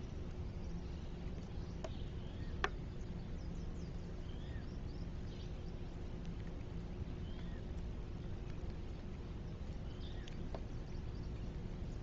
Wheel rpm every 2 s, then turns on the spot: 0, 0, 0, 0, 0, 0.
none